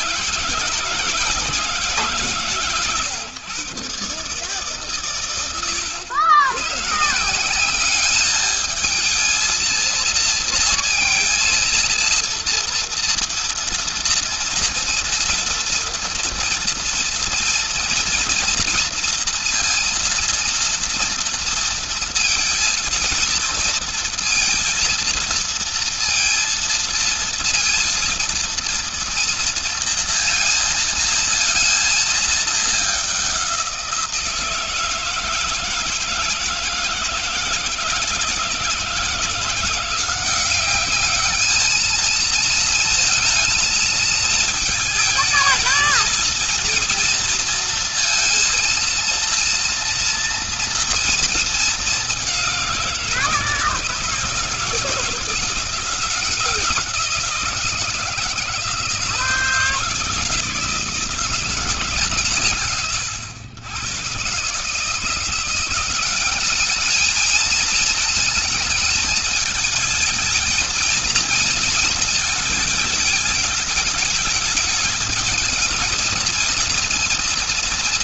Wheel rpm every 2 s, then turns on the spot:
160, 120, 100, 180, 230, 230, 230, 230, 230, 230, 230, 230, 230, 230, 230, 230, 190, 160, 160, 160, 210, 220, 220, 230, 230, 230, 170, 160, 170, 160, 160, 110, 150, 210, 220, 220, 220, 210, 230.
none